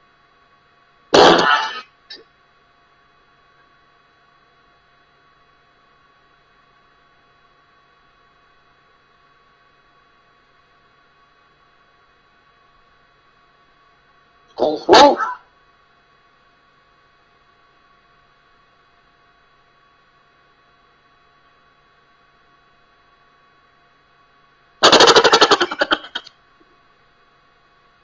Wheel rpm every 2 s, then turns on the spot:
0, 0, 0, 0, 0, 0, 0, 0, 0, 0, 0, 0, 0, 0.
none